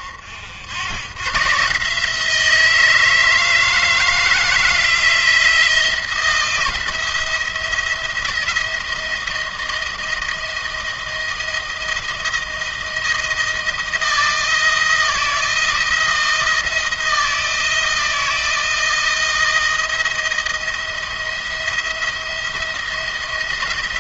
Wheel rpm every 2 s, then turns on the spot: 90, 160, 170, 170, 160, 160, 170, 170, 160, 170, 170, 170.
none